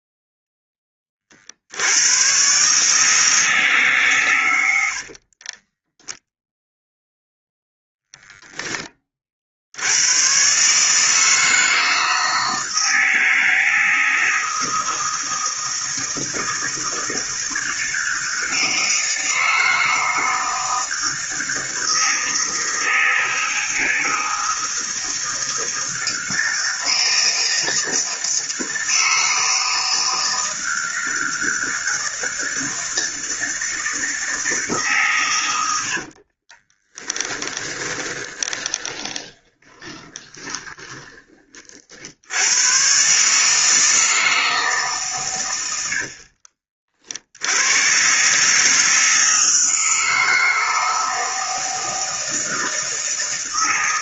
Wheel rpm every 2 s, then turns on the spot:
40, 160, 50, 0, 40, 160, 160, 160, 160, 160, 160, 160, 160, 160, 160, 160, 160, 110, 20, 20, 30, 150, 110, 80, 160, 160, 160.
4-6 36-40